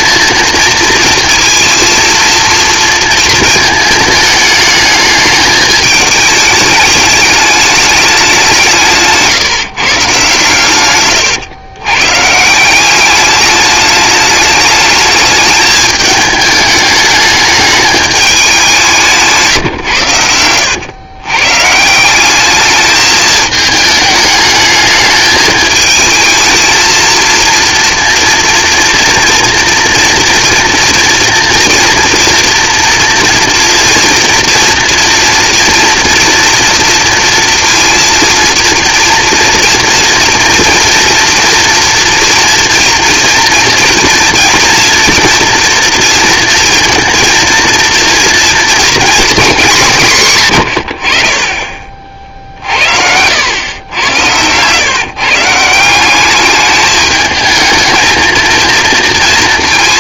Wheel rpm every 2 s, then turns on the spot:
230, 230, 210, 210, 170, 120, 180, 210, 210, 180, 100, 210, 210, 230, 230, 230, 230, 230, 230, 230, 230, 230, 230, 230, 230, 90, 60, 130, 210, 230.
none